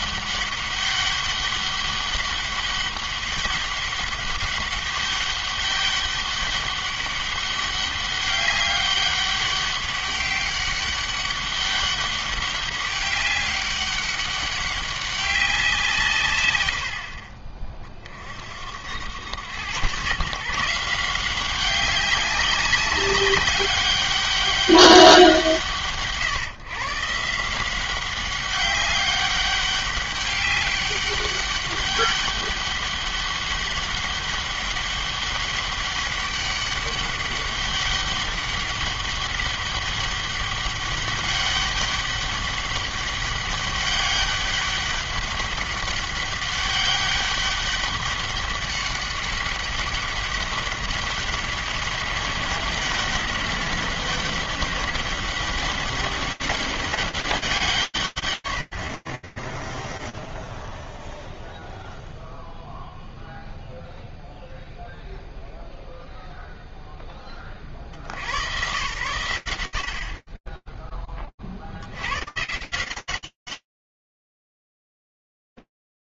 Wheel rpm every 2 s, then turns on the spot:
200, 200, 200, 200, 200, 200, 200, 200, 70, 90, 180, 190, 190, 150, 200, 200, 200, 200, 200, 200, 200, 200, 200, 200, 200, 200, 200, 190, 200, 20, 0, 0, 0, 70, 70, 20, 180, 30.
none